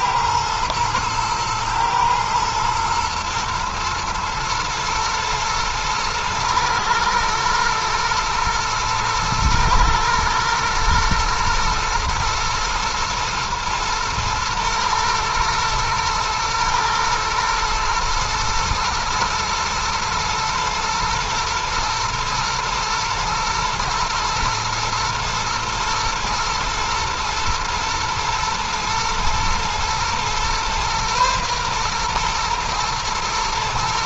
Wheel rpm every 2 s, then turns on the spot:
120, 120, 110, 110, 110, 110, 110, 120, 120, 110, 110, 110, 110, 110, 110, 120, 120.
none